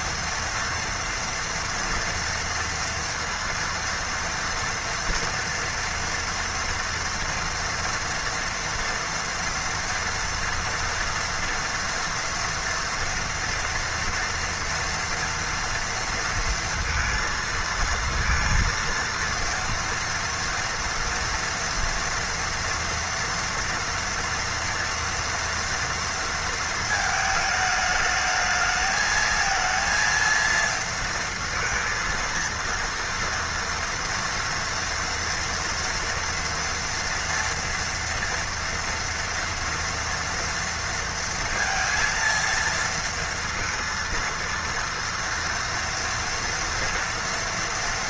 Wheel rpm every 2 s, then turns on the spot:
230, 230, 230, 230, 230, 240, 230, 230, 230, 230, 230, 230, 240, 230, 220, 230, 230, 230, 230, 230, 230, 230, 230, 230.
none